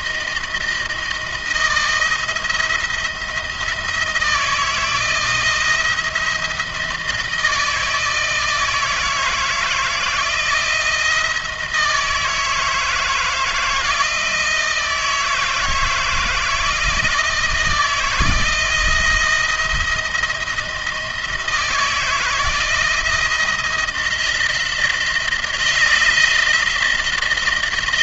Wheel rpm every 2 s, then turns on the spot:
160, 170, 160, 160, 160, 170, 160, 160, 170, 170, 160, 160, 170, 170.
none